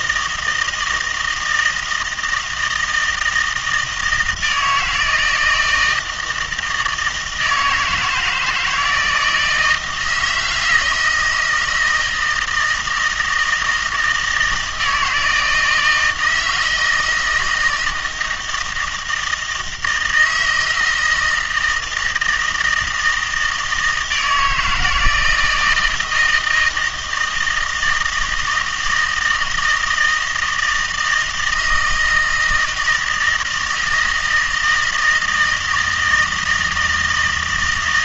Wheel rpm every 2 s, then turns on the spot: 160, 160, 160, 160, 160, 160, 160, 170, 160, 160, 160, 160, 160, 160, 160, 160, 160, 160, 160.
none